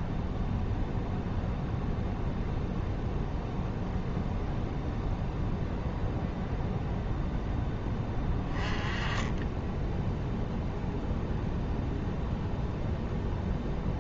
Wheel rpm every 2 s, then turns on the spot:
0, 0, 0, 0, 20, 0, 0.
none